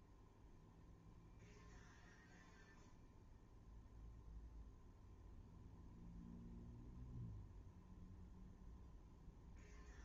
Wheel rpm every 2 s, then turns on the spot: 0, 0, 0, 0, 0.
none